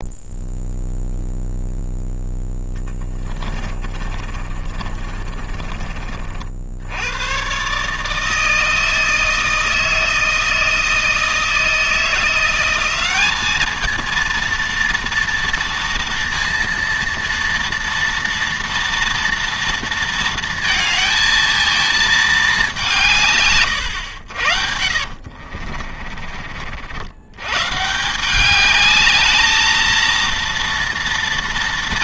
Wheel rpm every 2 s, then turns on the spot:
0, 10, 30, 80, 160, 160, 190, 230, 230, 230, 220, 180, 70, 70, 210, 230.
2-6 24-26